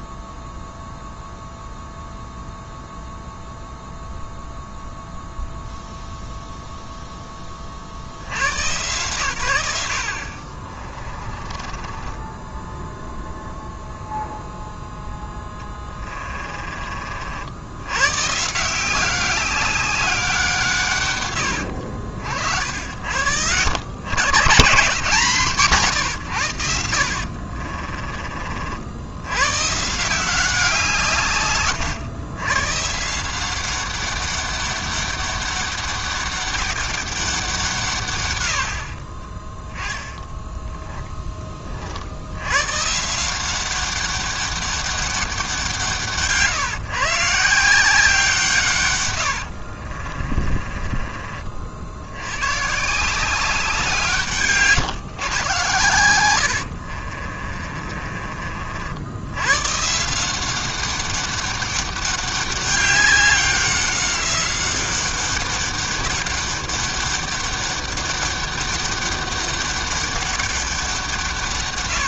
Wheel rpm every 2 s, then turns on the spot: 0, 0, 0, 0, 100, 40, 10, 0, 30, 160, 160, 70, 140, 90, 50, 170, 130, 200, 190, 70, 10, 110, 200, 150, 140, 30, 130, 140, 70, 50, 190, 200, 190, 200, 200, 190.
10-14 40-42 50-52 56-58